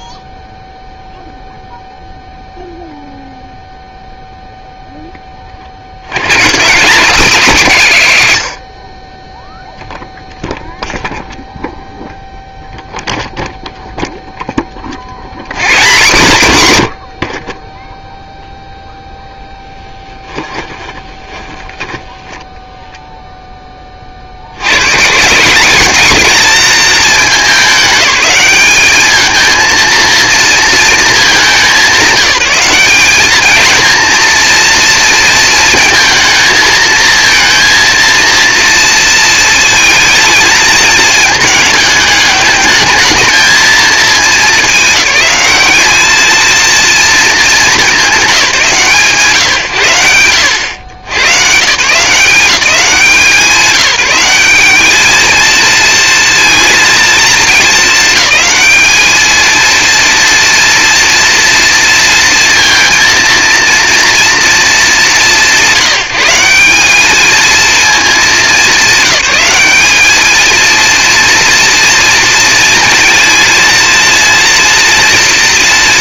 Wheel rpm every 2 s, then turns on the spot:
0, 0, 0, 190, 30, 0, 0, 50, 90, 0, 20, 0, 130, 220, 220, 220, 200, 230, 220, 230, 220, 220, 190, 230, 140, 110, 180, 210, 230, 220, 240, 230, 180, 210, 190, 230, 230, 230.
20-22